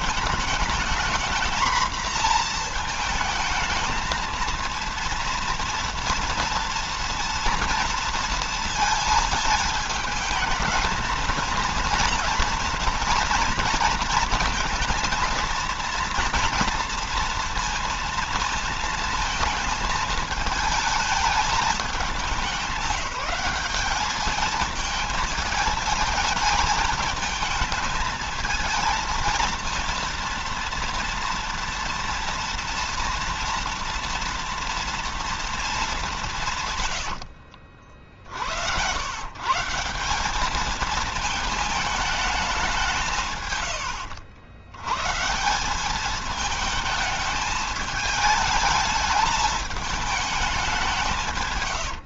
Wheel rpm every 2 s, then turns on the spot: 220, 230, 230, 230, 220, 220, 230, 230, 230, 230, 220, 200, 220, 220, 230, 230, 230, 230, 120, 100, 220, 180, 120, 220, 210, 170.
none